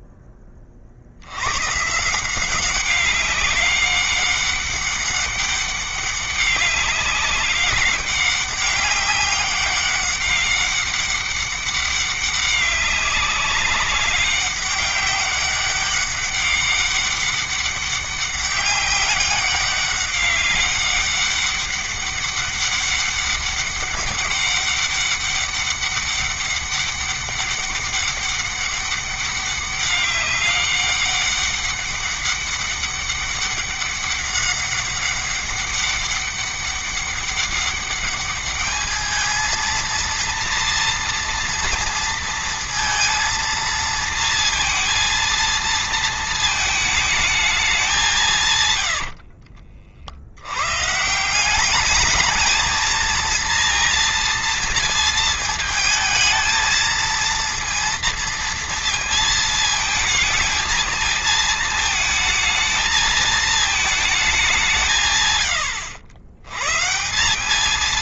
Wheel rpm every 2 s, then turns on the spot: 50, 190, 200, 200, 200, 200, 200, 200, 200, 200, 200, 200, 200, 200, 200, 200, 200, 200, 200, 210, 240, 230, 230, 220, 80, 150, 230, 230, 230, 230, 220, 220, 140, 140.
48-50